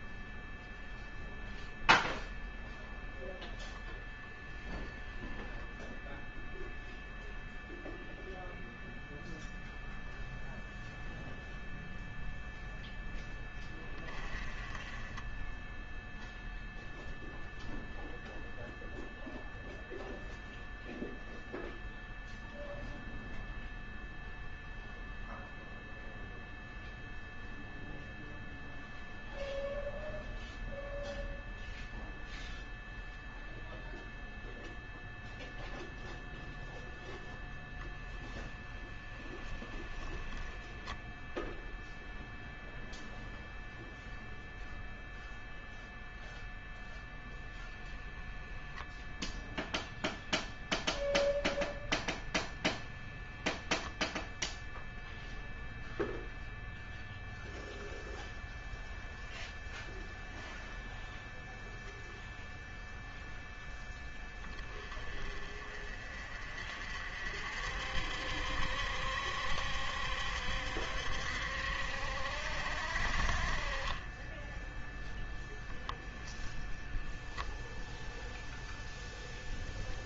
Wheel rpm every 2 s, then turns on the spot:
0, 0, 0, 0, 0, 0, 10, 20, 0, 0, 0, 0, 0, 0, 0, 0, 0, 0, 0, 20, 10, 0, 0, 0, 0, 0, 0, 0, 0, 0, 0, 0, 20, 50, 70, 70, 50, 0, 10, 0.
38-40 76-78